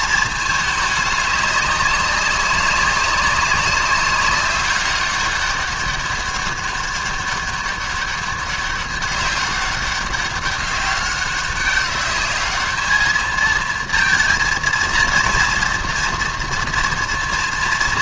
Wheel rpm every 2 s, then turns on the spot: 220, 200, 200, 200, 200, 200, 200, 230, 230.
none